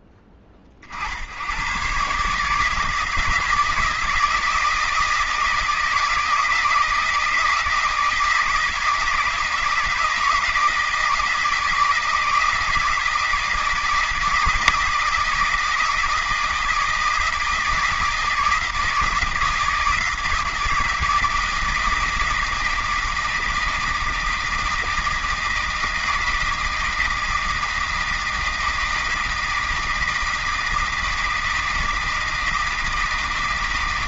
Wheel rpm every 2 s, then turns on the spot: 80, 160, 160, 160, 160, 160, 160, 160, 160, 160, 160, 160, 160, 160, 160, 160, 160.
none